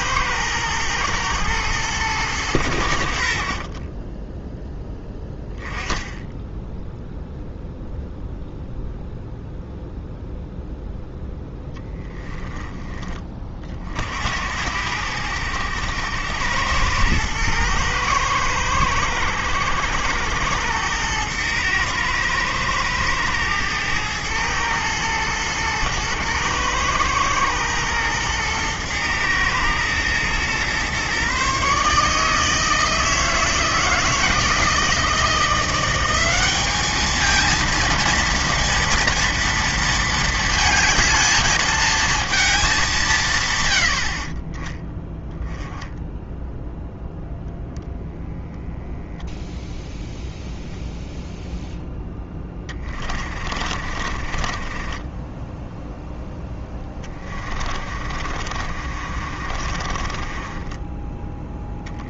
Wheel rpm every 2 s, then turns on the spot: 110, 90, 10, 10, 0, 0, 10, 70, 100, 100, 100, 110, 110, 110, 120, 120, 160, 160, 210, 230, 220, 210, 20, 0, 0, 0, 20, 20, 10, 50, 20.
52-62